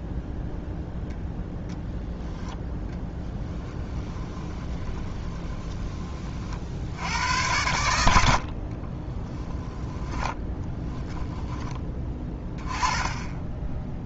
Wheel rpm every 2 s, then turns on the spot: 0, 0, 20, 70, 30, 10, 10.
4-6 8-12